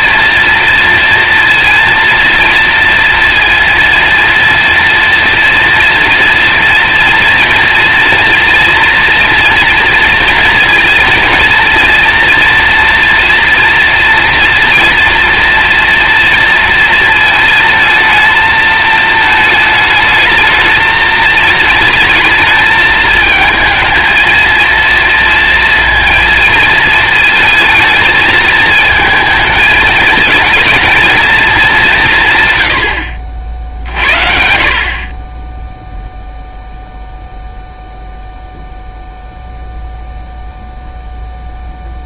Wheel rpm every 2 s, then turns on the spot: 240, 230, 230, 230, 230, 240, 230, 230, 240, 220, 220, 220, 220, 230, 220, 220, 160, 60, 0, 0, 0.
none